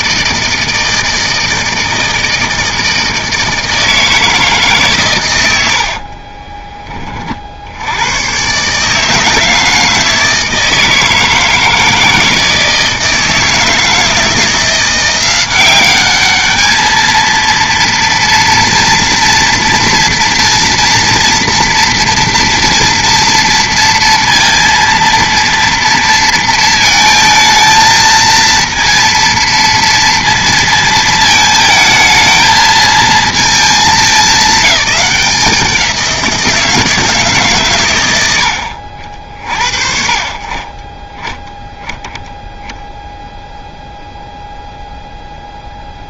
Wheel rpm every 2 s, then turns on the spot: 160, 160, 140, 20, 150, 160, 160, 170, 220, 230, 230, 230, 230, 230, 230, 220, 220, 210, 160, 70, 20, 0, 0.
none